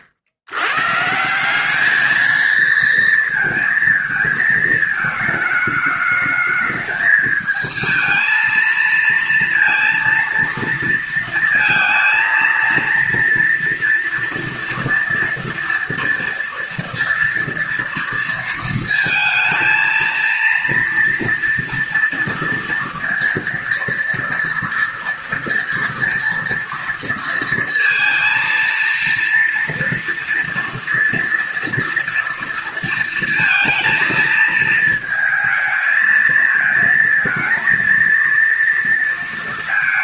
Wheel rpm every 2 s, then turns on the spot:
90, 220, 220, 210, 230, 230, 230, 230, 230, 230, 230, 230, 230, 230, 230, 230, 230, 230, 230, 230.
none